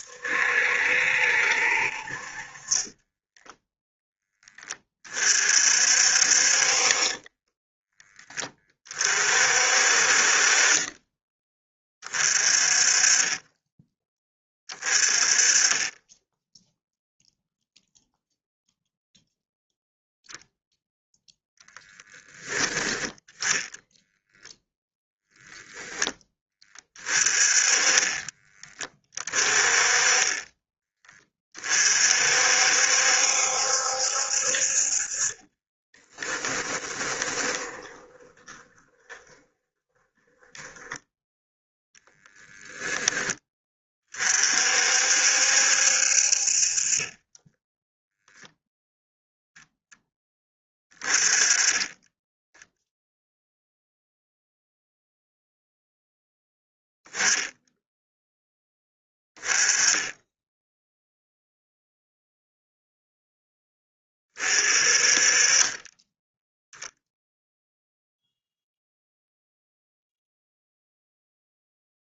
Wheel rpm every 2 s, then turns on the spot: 70, 20, 30, 30, 40, 20, 30, 30, 0, 0, 0, 10, 0, 20, 20, 20, 70, 40, 20, 20, 10, 10, 60, 30, 0, 20, 0, 0, 0, 10, 0, 0, 30, 0, 0, 0.
2-4 6-8 10-12 36-42